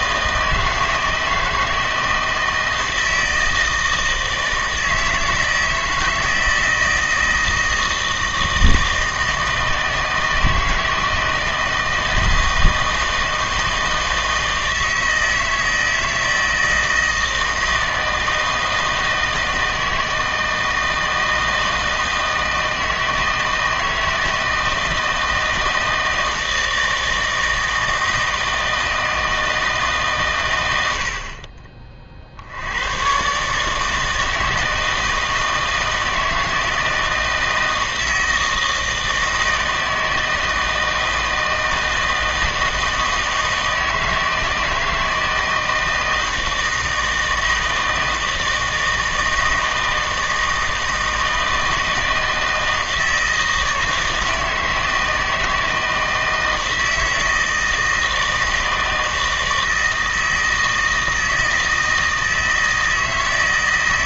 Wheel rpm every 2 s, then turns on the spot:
160, 160, 160, 160, 160, 160, 160, 160, 160, 160, 160, 160, 160, 160, 160, 90, 90, 160, 160, 160, 160, 160, 160, 160, 160, 160, 160, 160, 160, 160, 160, 160.
none